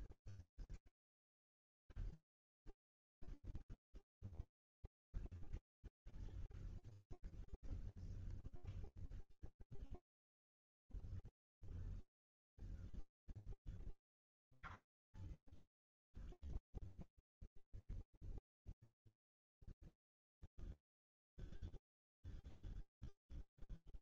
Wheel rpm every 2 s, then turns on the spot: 0, 0, 0, 0, 0, 0, 0, 0, 0, 0, 0, 0.
none